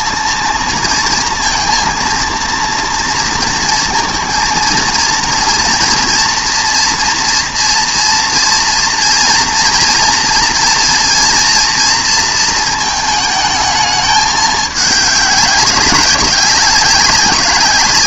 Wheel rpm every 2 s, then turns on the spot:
230, 230, 230, 230, 230, 230, 230, 210, 190.
none